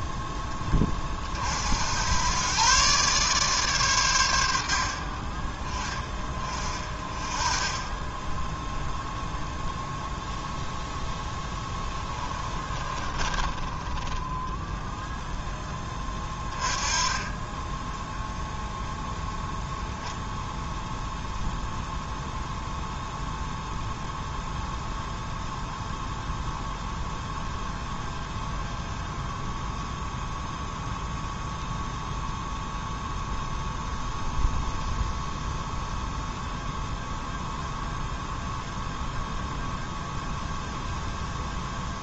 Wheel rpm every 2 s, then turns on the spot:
10, 130, 70, 30, 0, 0, 20, 10, 20, 0, 0, 0, 0, 0, 0, 0, 0, 0, 0, 0, 0.
12-14